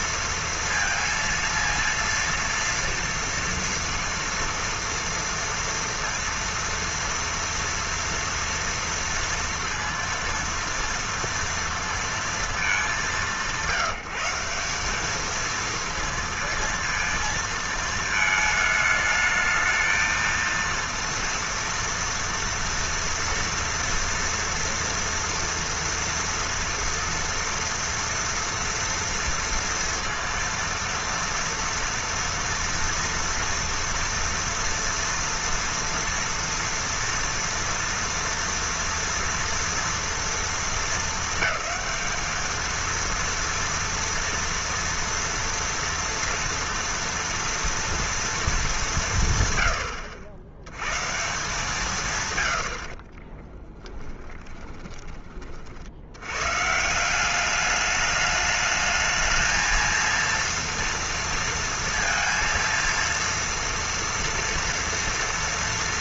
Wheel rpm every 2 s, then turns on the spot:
230, 230, 230, 230, 230, 230, 200, 200, 230, 220, 230, 230, 230, 230, 230, 230, 230, 230, 230, 230, 210, 220, 230, 230, 230, 110, 50, 20, 150, 220, 230, 230, 230.
52-56